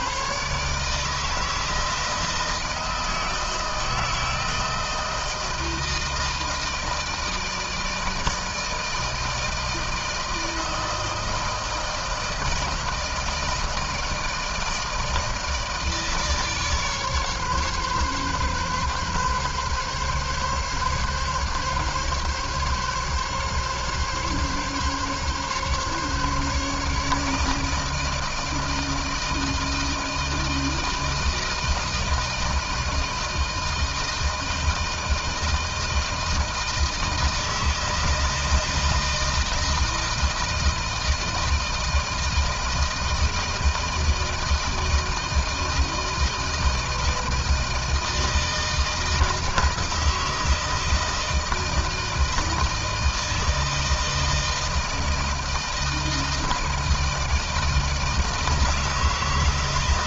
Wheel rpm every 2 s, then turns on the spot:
140, 160, 160, 160, 160, 160, 160, 160, 150, 140, 140, 140, 140, 150, 160, 160, 160, 160, 160, 160, 160, 160, 160, 160, 160, 160, 160, 160, 170, 160.
none